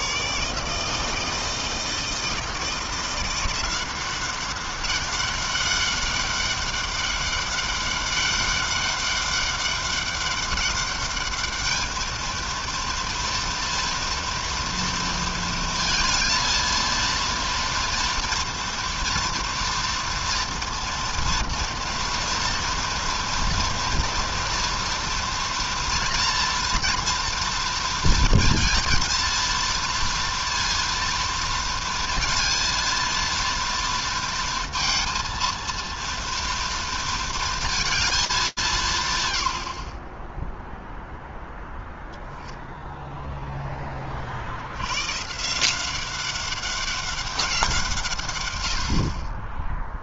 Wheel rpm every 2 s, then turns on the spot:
160, 180, 200, 200, 200, 210, 230, 230, 230, 230, 230, 230, 230, 230, 230, 230, 230, 230, 230, 100, 0, 10, 180, 170, 0.
none